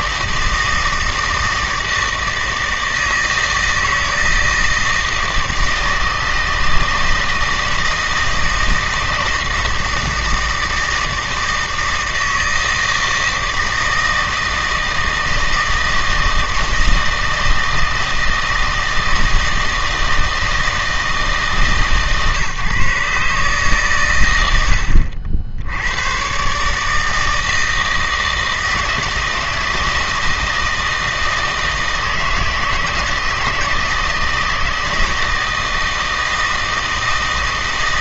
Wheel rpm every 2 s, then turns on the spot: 160, 160, 160, 160, 160, 160, 160, 160, 160, 160, 160, 140, 80, 160, 160, 160, 160, 160, 160.
none